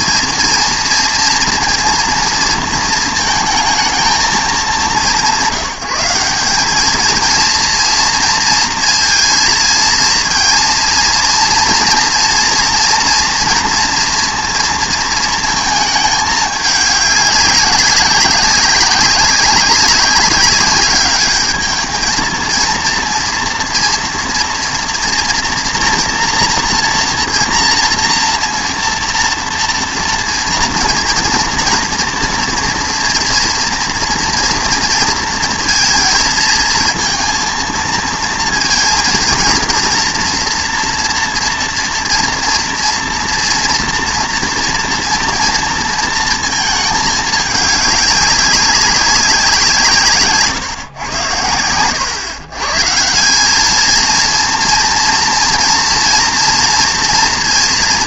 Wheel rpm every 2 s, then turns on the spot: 230, 230, 200, 200, 230, 230, 230, 230, 210, 190, 200, 230, 230, 240, 230, 230, 240, 230, 230, 230, 230, 230, 240, 220, 190, 130, 140, 230, 230.
none